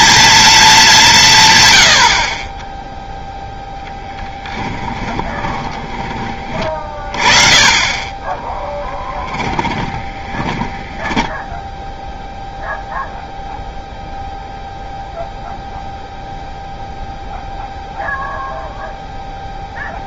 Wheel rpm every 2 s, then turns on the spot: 220, 20, 20, 30, 10, 20, 0, 0, 0, 0.
4-6 8-12